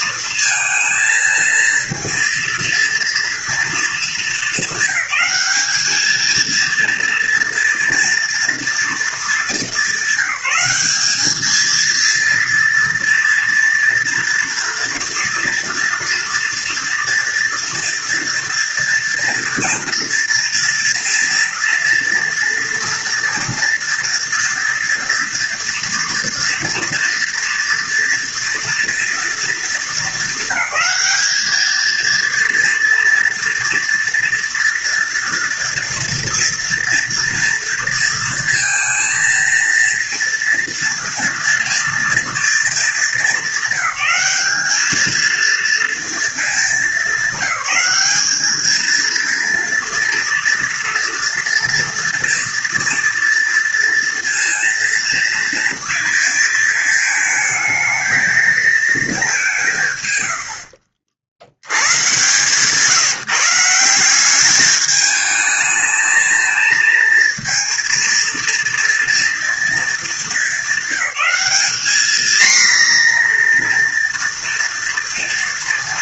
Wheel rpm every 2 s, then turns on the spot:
220, 230, 200, 230, 220, 210, 230, 230, 230, 230, 230, 230, 230, 230, 230, 200, 230, 230, 230, 230, 230, 210, 210, 210, 220, 230, 230, 230, 220, 210, 60, 160, 210, 230, 230, 200, 240, 230.
none